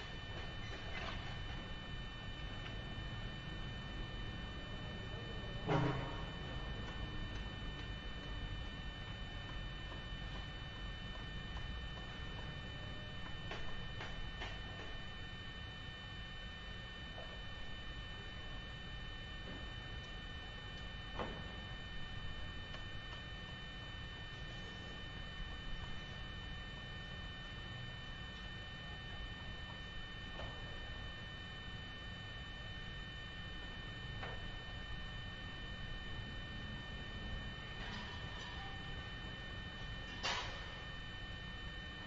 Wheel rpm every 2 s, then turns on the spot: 0, 0, 0, 0, 0, 0, 0, 0, 0, 0, 0, 0, 0, 0, 0, 0, 0, 0, 0, 0, 0.
none